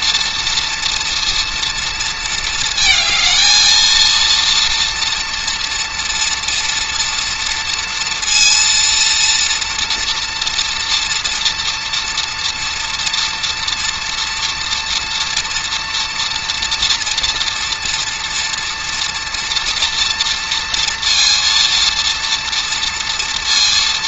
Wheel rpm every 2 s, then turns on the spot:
230, 220, 230, 230, 230, 230, 240, 240, 230, 240, 230, 230.
none